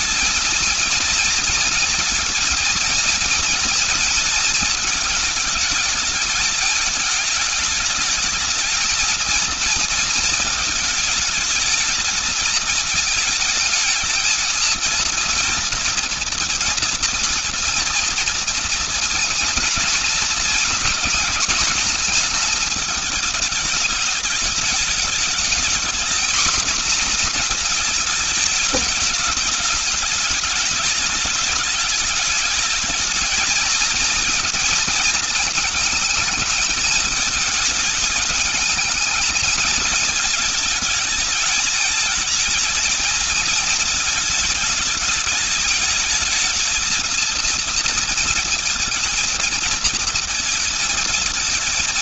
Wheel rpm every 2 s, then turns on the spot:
230, 230, 220, 210, 220, 220, 220, 230, 230, 230, 230, 220, 210, 240, 220, 210, 210, 230, 210, 210, 220, 220, 210, 230, 230, 230.
none